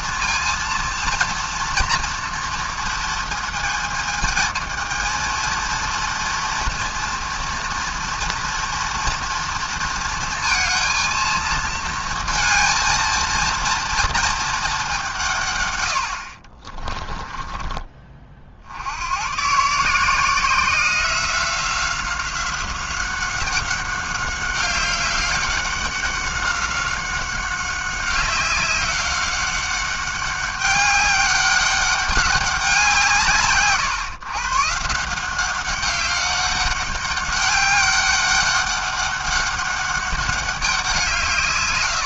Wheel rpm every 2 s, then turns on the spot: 230, 230, 220, 230, 230, 220, 230, 200, 30, 70, 180, 190, 200, 190, 200, 200, 170, 150, 200, 200, 180.
16-18